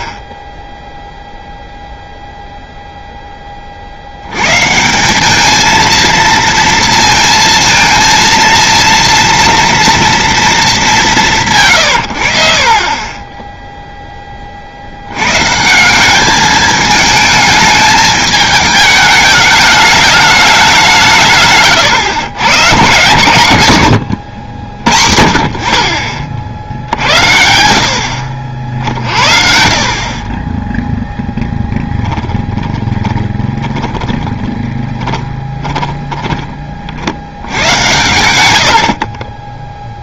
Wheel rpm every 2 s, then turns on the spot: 0, 0, 150, 230, 230, 210, 40, 60, 210, 210, 190, 120, 70, 50, 50, 10, 20, 20, 30, 80.
32-36